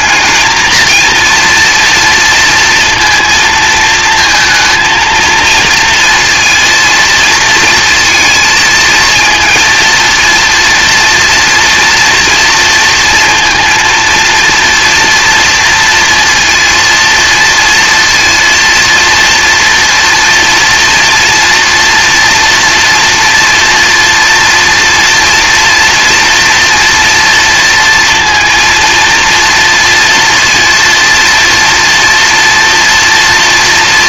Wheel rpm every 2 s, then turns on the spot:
230, 230, 230, 230, 230, 230, 230, 230, 230, 230, 230, 230, 230, 230, 230, 230, 230.
none